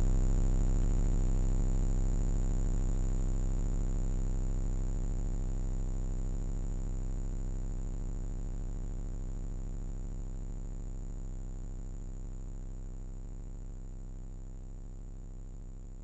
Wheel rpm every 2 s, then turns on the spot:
0, 0, 0, 0, 0, 0, 0, 0.
none